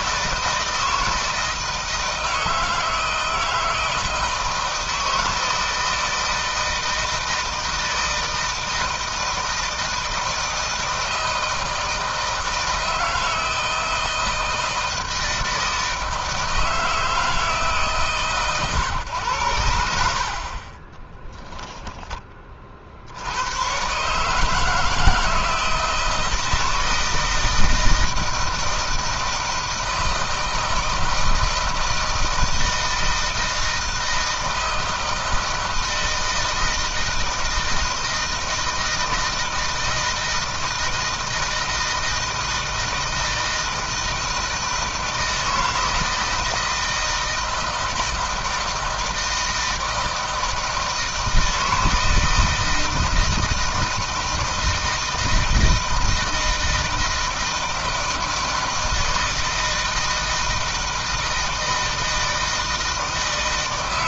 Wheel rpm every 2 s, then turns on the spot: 160, 160, 160, 160, 160, 160, 160, 160, 160, 130, 40, 40, 150, 160, 160, 160, 160, 160, 160, 160, 160, 160, 160, 160, 160, 160, 160, 160, 160, 160, 160, 160.
none